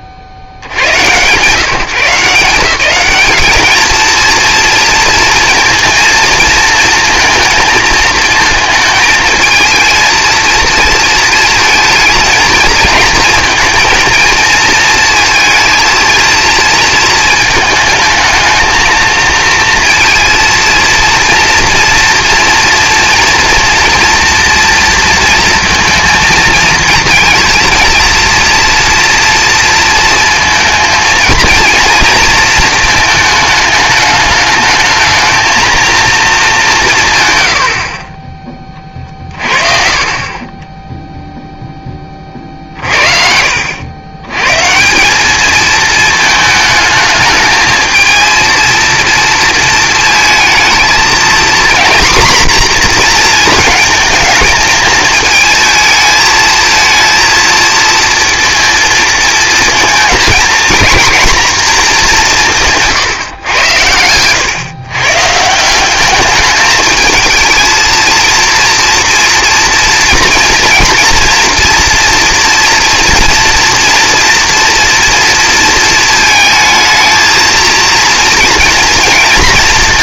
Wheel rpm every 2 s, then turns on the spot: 30, 180, 230, 230, 220, 220, 220, 230, 230, 220, 230, 230, 230, 230, 230, 220, 230, 220, 170, 20, 10, 50, 160, 220, 230, 230, 240, 220, 220, 230, 230, 160, 130, 220, 230, 230, 230, 240, 220, 230.
none